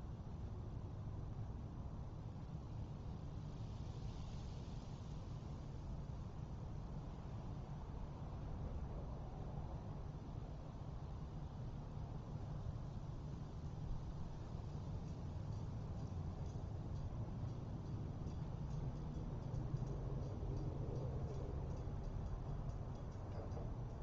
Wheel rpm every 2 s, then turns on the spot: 0, 0, 0, 0, 0, 0, 0, 0, 0, 0, 0, 0.
none